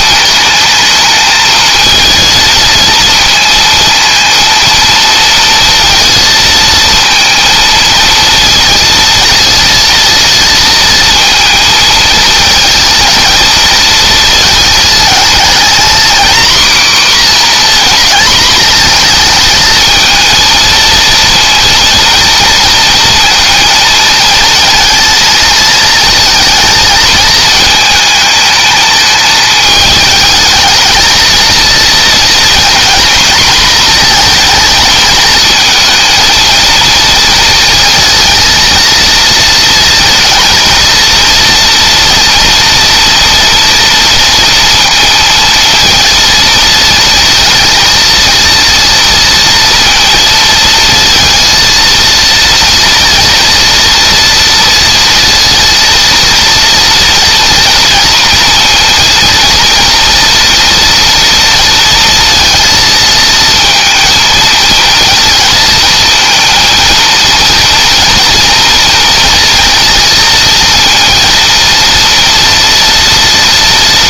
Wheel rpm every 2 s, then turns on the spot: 220, 230, 230, 230, 230, 230, 220, 230, 250, 220, 230, 230, 220, 220, 220, 220, 240, 220, 230, 230, 240, 230, 230, 230, 230, 230, 230, 230, 230, 230, 230, 230, 230, 230, 240, 230, 230.
none